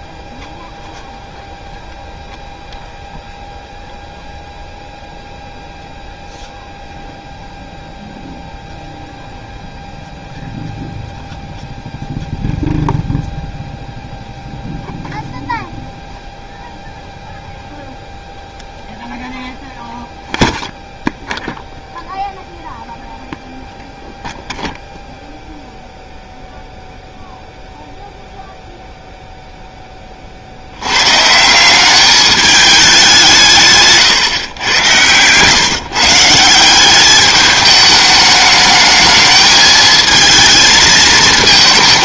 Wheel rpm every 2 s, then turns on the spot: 0, 0, 0, 0, 0, 0, 0, 0, 0, 0, 0, 0, 0, 0, 0, 70, 210, 120, 180, 210, 220.
none